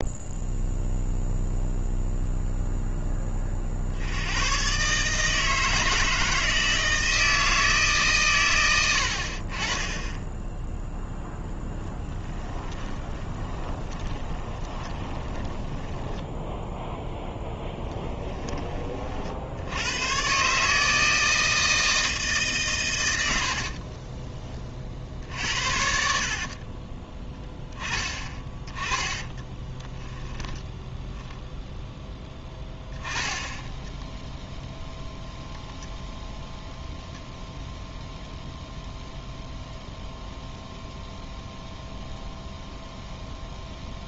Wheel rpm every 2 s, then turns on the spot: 0, 0, 110, 160, 120, 10, 10, 20, 0, 20, 140, 150, 20, 50, 20, 10, 10, 0, 0, 0, 0, 0.
12-16 26-30